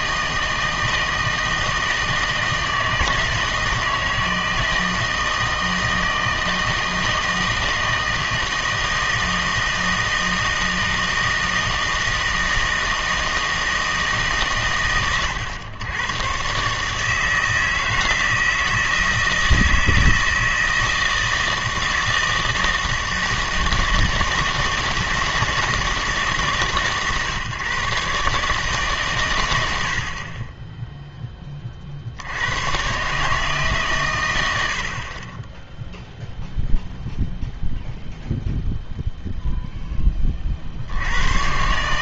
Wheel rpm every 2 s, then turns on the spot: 160, 160, 160, 160, 160, 160, 160, 130, 140, 160, 160, 160, 160, 150, 150, 20, 110, 80, 0, 0, 40.
none